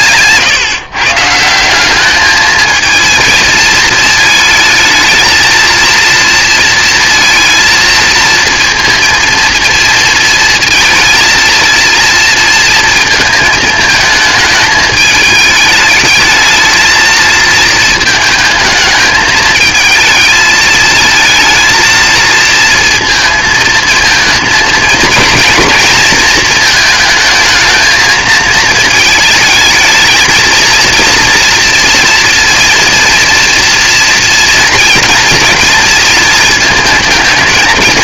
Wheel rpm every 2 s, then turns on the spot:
150, 220, 220, 230, 230, 230, 230, 220, 220, 220, 220, 230, 220, 220, 220, 230, 230, 230, 230.
none